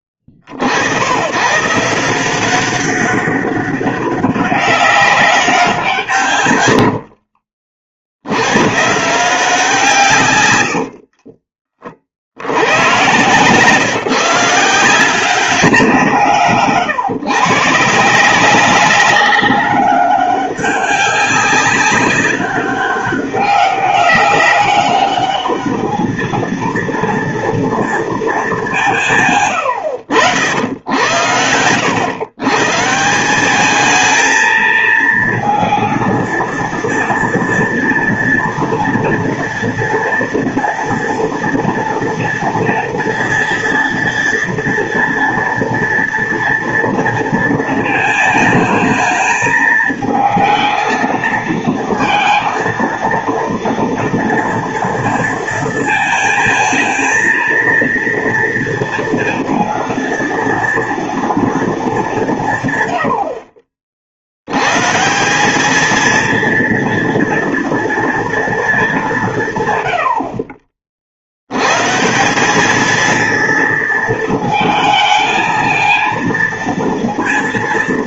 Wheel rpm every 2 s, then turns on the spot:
50, 180, 200, 130, 110, 100, 80, 160, 140, 180, 200, 190, 200, 230, 200, 80, 140, 230, 230, 230, 230, 230, 240, 230, 220, 220, 230, 240, 220, 230, 230, 140, 110, 230, 220, 40, 200, 230, 230.
10-12